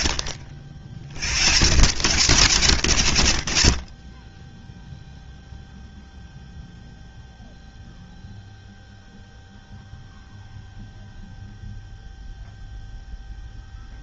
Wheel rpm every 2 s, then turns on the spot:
90, 30, 0, 0, 0, 0, 0.
none